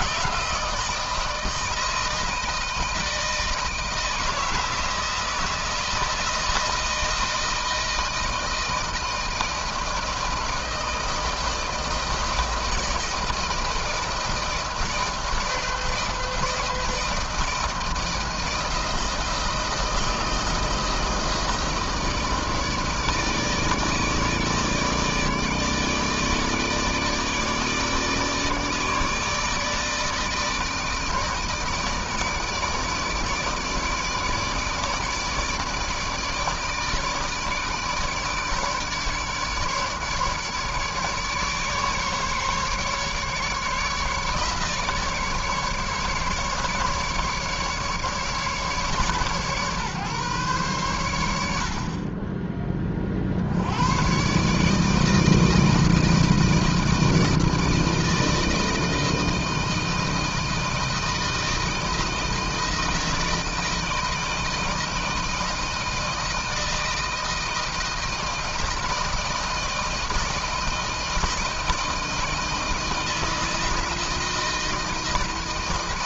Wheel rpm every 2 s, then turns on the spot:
160, 160, 170, 160, 160, 160, 160, 160, 160, 160, 160, 160, 150, 150, 160, 150, 160, 150, 150, 150, 150, 150, 150, 150, 150, 130, 30, 140, 160, 160, 160, 160, 160, 160, 160, 160, 160, 170.
none